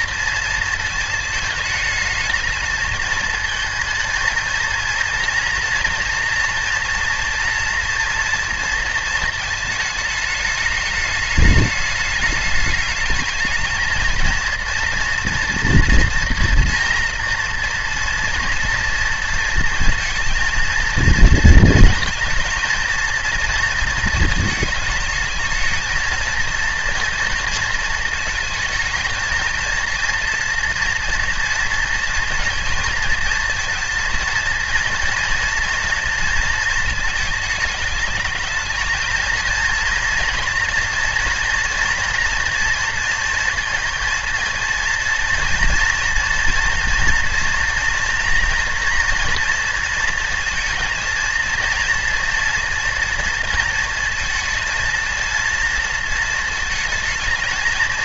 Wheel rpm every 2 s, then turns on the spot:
230, 220, 230, 230, 230, 210, 210, 230, 240, 230, 230, 230, 220, 230, 220, 230, 230, 230, 230, 220, 230, 230, 230, 240, 230, 230, 230, 230, 230.
none